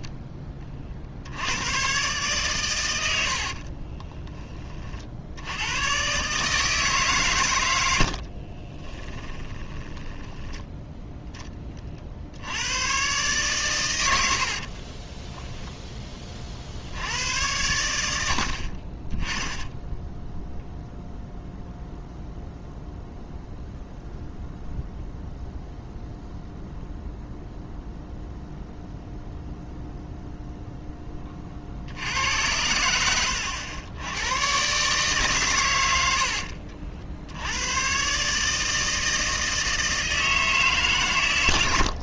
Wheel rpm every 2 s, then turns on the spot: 30, 110, 40, 150, 30, 0, 110, 50, 60, 40, 0, 0, 0, 0, 0, 10, 90, 130, 60, 160, 140.
8-10 14-16 18-20